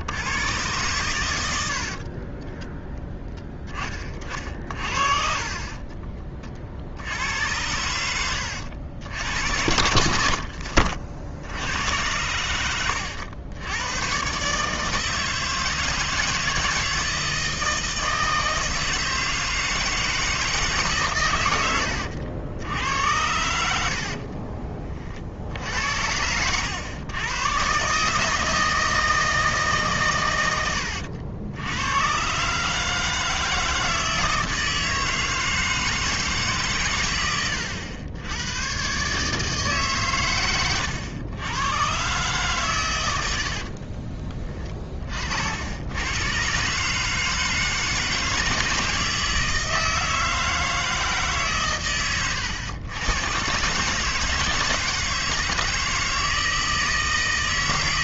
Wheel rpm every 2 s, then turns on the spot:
120, 10, 40, 50, 90, 60, 100, 150, 170, 160, 150, 90, 30, 90, 160, 90, 150, 160, 140, 120, 110, 130, 30, 130, 160, 160, 100, 160, 160.
4-6 10-14